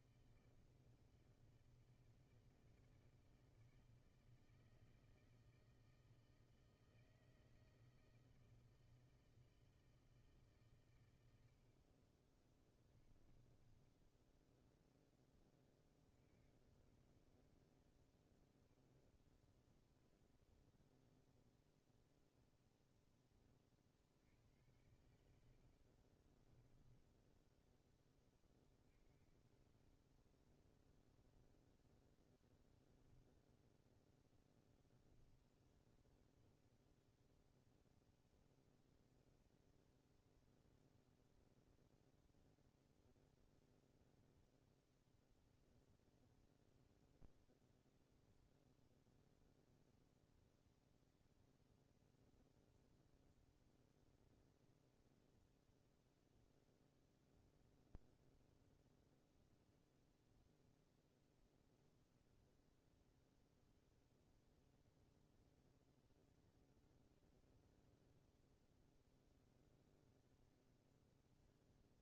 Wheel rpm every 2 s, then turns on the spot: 160, 160, 160, 160, 160, 150, 30, 10, 50, 30, 30, 0, 70, 20, 30, 10, 0, 0, 0, 0, 0, 0, 0, 0, 0, 0, 0, 0, 0, 0, 0, 0, 0, 0, 0, 0.
12-14 26-28